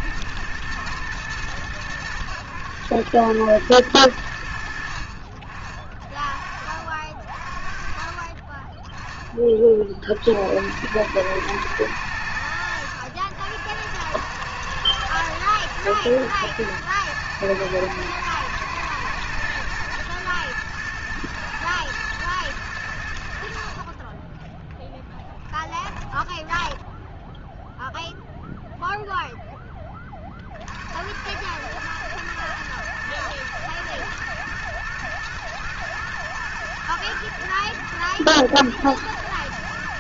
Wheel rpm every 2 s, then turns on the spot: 120, 110, 70, 50, 20, 80, 90, 110, 120, 110, 120, 110, 10, 10, 0, 50, 110, 120, 120, 110.
26-28